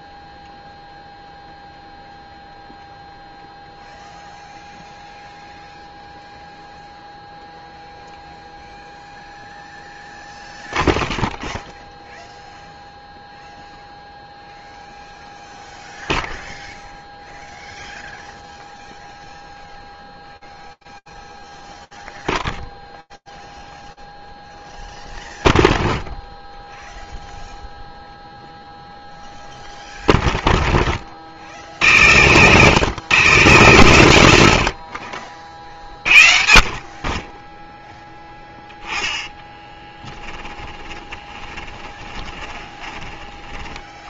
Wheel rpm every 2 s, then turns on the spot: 0, 0, 0, 0, 0, 0, 0, 0, 0, 0, 0, 0, 0, 0, 0, 70, 90, 40, 10, 20, 30, 70.
38-42